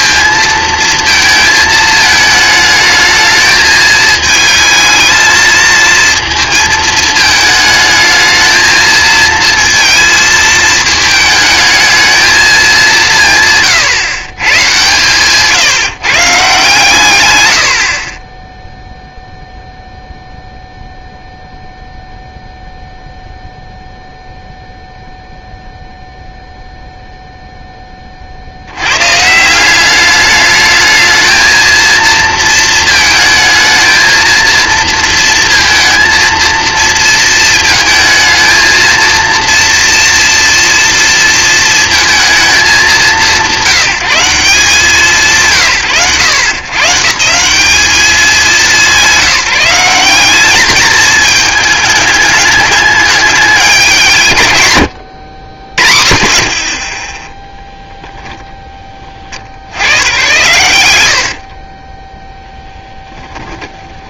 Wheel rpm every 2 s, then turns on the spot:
230, 220, 220, 220, 230, 220, 210, 140, 140, 0, 0, 0, 0, 0, 100, 220, 230, 230, 230, 220, 230, 200, 180, 160, 170, 220, 210, 120, 50, 20, 110, 10.
60-62